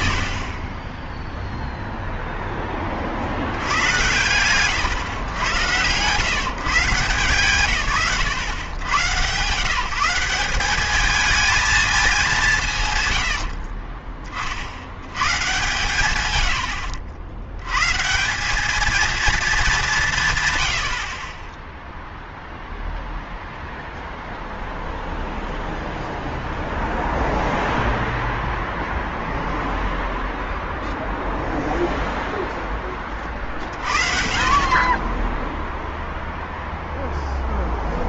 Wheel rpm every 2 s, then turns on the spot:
20, 20, 120, 140, 100, 200, 150, 50, 90, 210, 110, 0, 0, 0, 0, 0, 10, 30, 0.
0-2